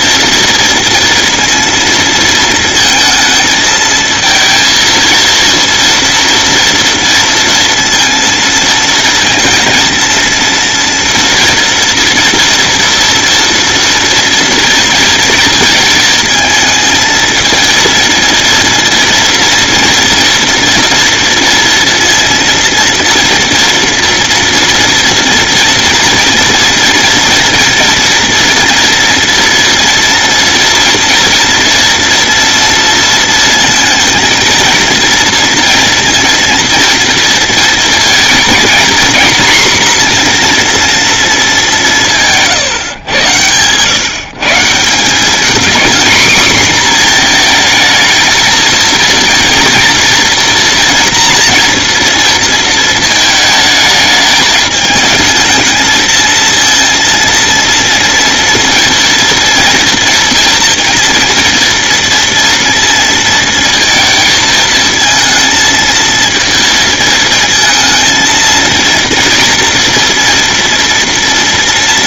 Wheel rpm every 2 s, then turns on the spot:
230, 230, 230, 230, 230, 230, 240, 230, 220, 230, 230, 230, 230, 230, 230, 230, 230, 230, 230, 230, 240, 140, 160, 240, 220, 230, 230, 210, 230, 230, 230, 230, 220, 230, 230, 230.
none